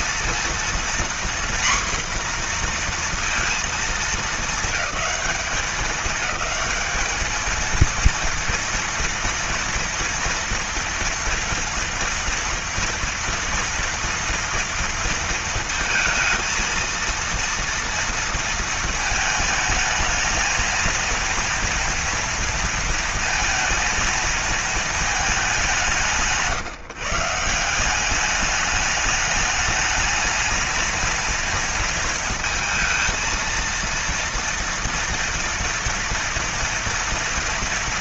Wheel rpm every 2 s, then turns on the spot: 240, 240, 210, 210, 230, 230, 230, 230, 230, 220, 230, 230, 220, 150, 210, 230, 230, 230, 230.
none